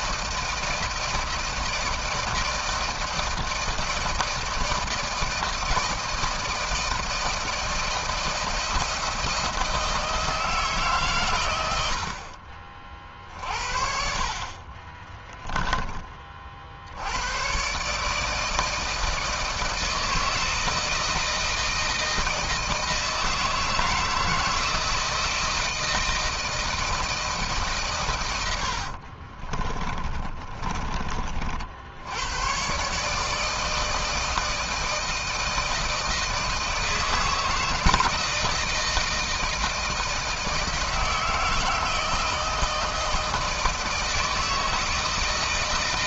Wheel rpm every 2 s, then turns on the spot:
160, 160, 160, 160, 160, 140, 40, 30, 80, 160, 160, 160, 160, 160, 60, 40, 140, 160, 160, 160, 160, 160, 160.
14-16 28-30